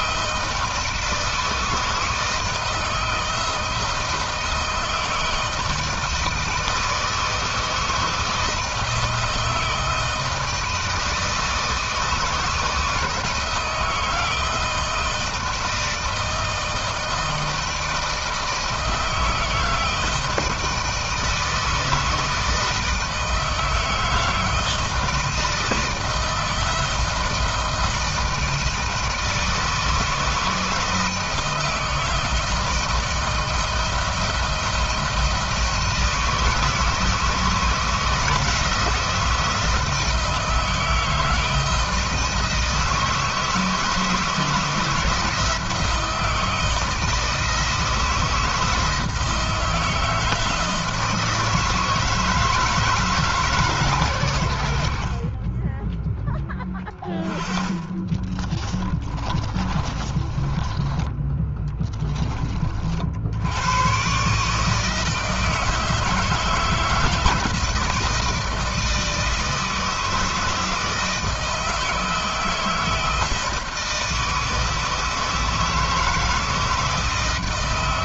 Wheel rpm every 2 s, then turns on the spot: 160, 160, 160, 160, 160, 160, 160, 160, 160, 160, 160, 160, 160, 160, 160, 160, 160, 160, 160, 160, 160, 160, 160, 160, 160, 160, 150, 40, 20, 30, 10, 70, 160, 160, 160, 160, 160, 160, 160.
56-60